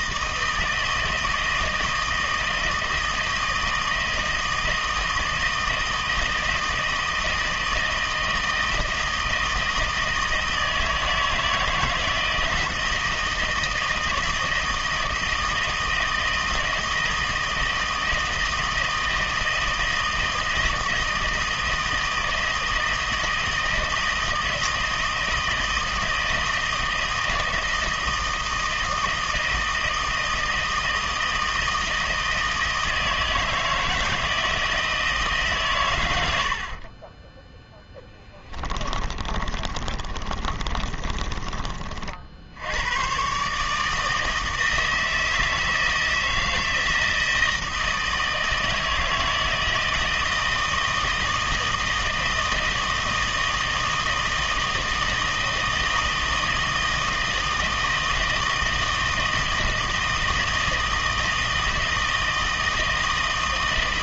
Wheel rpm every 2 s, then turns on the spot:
160, 160, 160, 160, 160, 160, 160, 160, 160, 160, 160, 160, 160, 160, 160, 160, 160, 160, 50, 20, 40, 90, 160, 160, 160, 160, 160, 160, 160, 160, 160, 160.
38-42